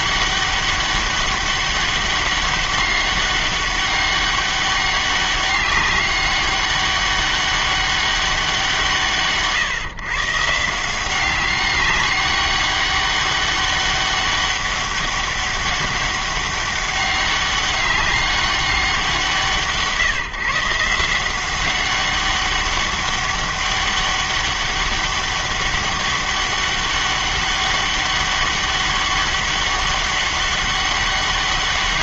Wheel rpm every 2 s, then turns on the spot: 200, 200, 200, 200, 180, 160, 200, 200, 200, 190, 150, 190, 200, 200, 200, 200.
none